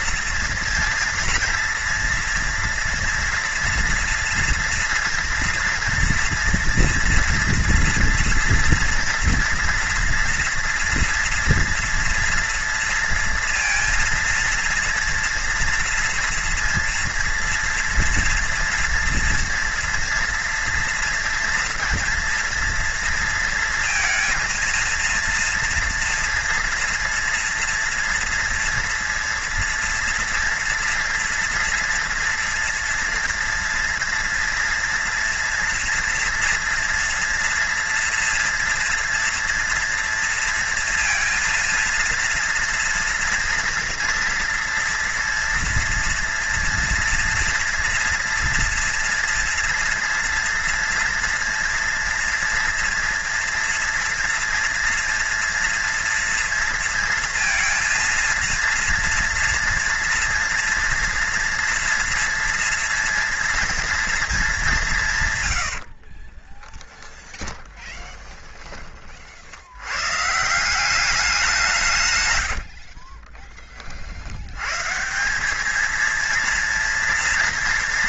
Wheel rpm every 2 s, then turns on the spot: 230, 230, 230, 230, 230, 230, 230, 230, 240, 240, 230, 230, 230, 230, 230, 230, 230, 230, 240, 230, 230, 230, 230, 230, 230, 230, 230, 230, 230, 230, 230, 230, 210, 40, 30, 170, 90, 110, 230.
66-68 72-74